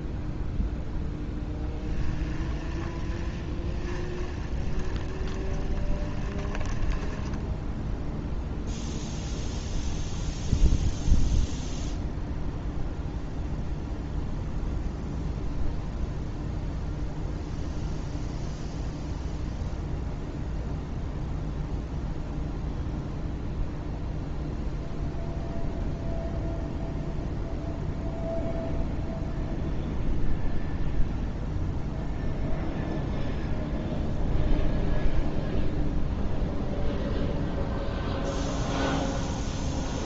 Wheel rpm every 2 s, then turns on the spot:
0, 20, 10, 10, 0, 0, 0, 0, 0, 0, 0, 0, 0, 0, 0, 0, 0, 0, 0, 0.
2-8